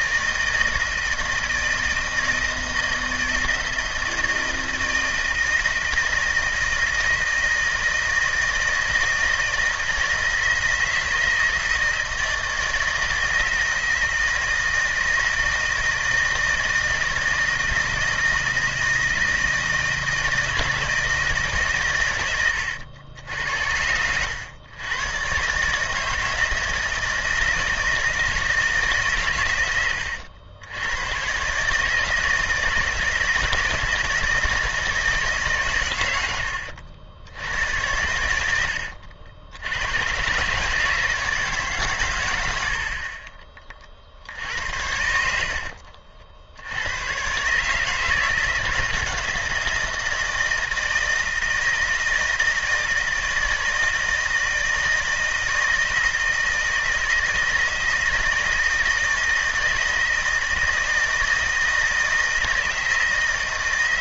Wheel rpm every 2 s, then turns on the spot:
160, 160, 160, 160, 160, 160, 160, 160, 160, 160, 160, 90, 100, 160, 150, 90, 160, 160, 80, 90, 140, 90, 70, 80, 160, 160, 160, 160, 160, 160, 160, 160.
38-40